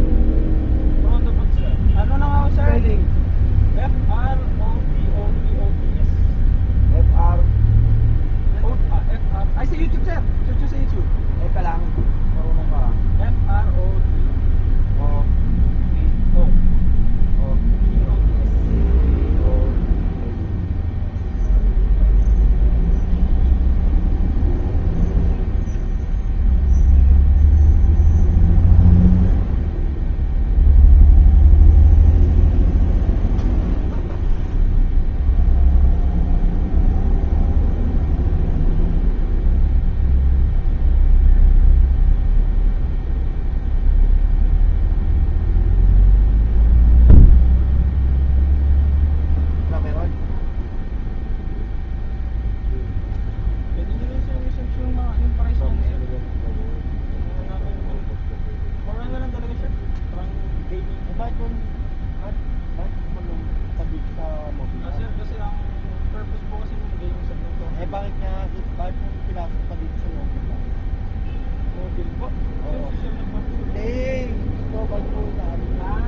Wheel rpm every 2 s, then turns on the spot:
0, 0, 0, 0, 0, 0, 0, 0, 0, 0, 0, 0, 0, 0, 0, 0, 0, 0, 0, 0, 0, 0, 0, 0, 0, 0, 0, 0, 0, 0, 0, 0, 0, 0, 0, 0, 0, 0.
none